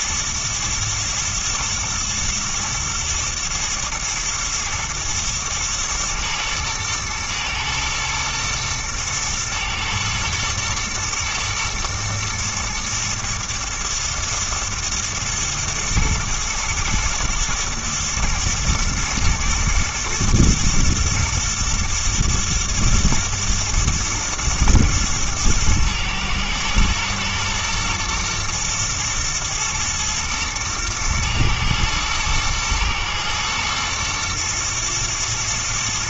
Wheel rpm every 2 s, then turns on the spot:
120, 120, 110, 110, 110, 110, 110, 110, 120, 110, 110, 110, 110, 110, 120, 120, 110, 120.
none